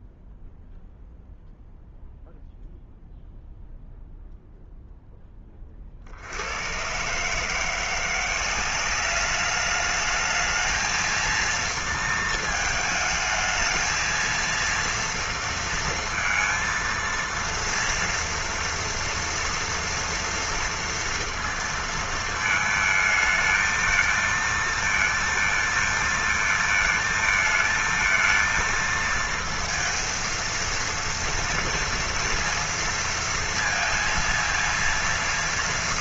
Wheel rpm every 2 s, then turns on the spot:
0, 0, 0, 110, 190, 220, 220, 230, 230, 230, 230, 220, 230, 230, 230, 230, 230, 230.
none